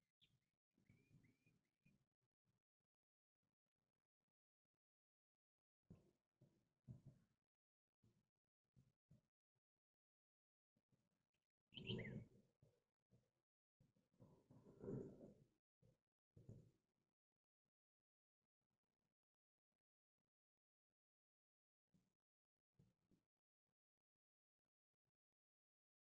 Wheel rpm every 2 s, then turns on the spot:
0, 0, 0, 0, 0, 0, 0, 0, 0, 0, 0, 0, 0.
none